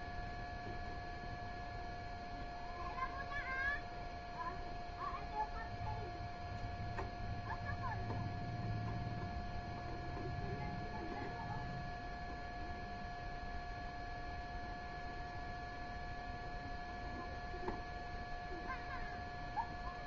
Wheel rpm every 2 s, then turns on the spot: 0, 0, 0, 0, 0, 0, 0, 0, 0, 0.
none